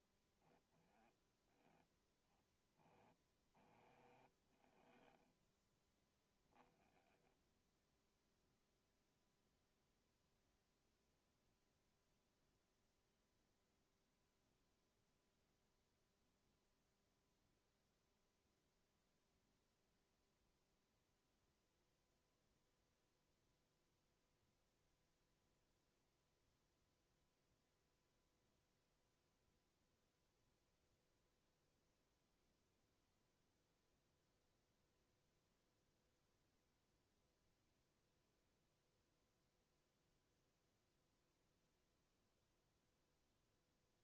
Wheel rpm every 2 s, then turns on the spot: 0, 10, 10, 10, 0, 0, 0, 0, 0, 0, 0, 0, 0, 0, 0, 0, 0, 0, 0, 0, 0, 0.
2-6